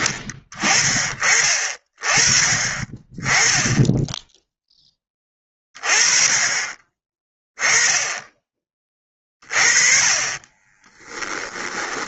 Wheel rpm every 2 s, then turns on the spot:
20, 30, 10, 30, 20, 30.
10-12